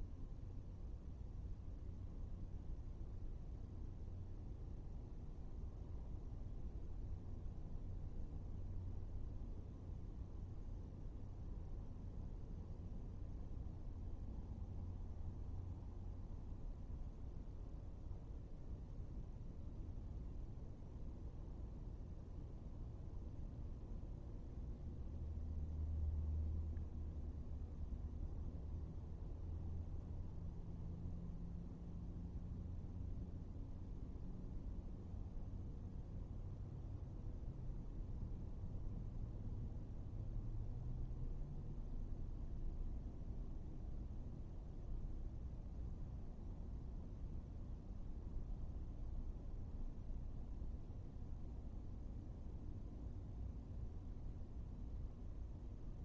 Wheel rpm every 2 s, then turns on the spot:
0, 0, 0, 0, 0, 0, 0, 0, 0, 0, 0, 0, 0, 0, 0, 0, 0, 0, 0, 0, 0, 0, 0, 0, 0, 0, 0, 0.
none